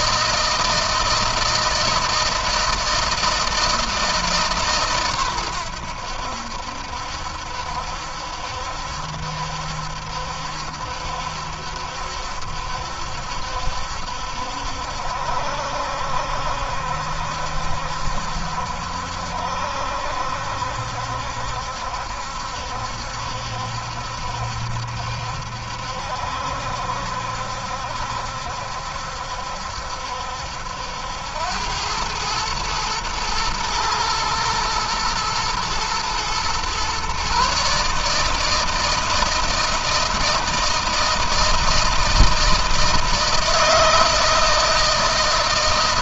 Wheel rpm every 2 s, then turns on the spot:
160, 160, 130, 70, 70, 70, 70, 70, 70, 70, 70, 70, 70, 70, 70, 80, 110, 120, 130, 160, 160, 160, 160.
none